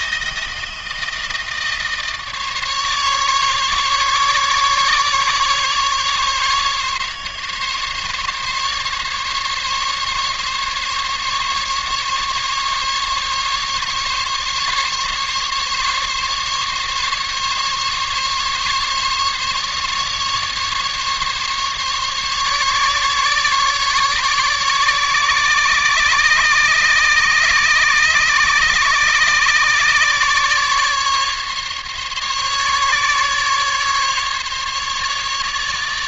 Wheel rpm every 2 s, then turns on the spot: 160, 150, 140, 140, 150, 140, 140, 140, 140, 140, 150, 140, 140, 140, 140, 140, 140, 150.
none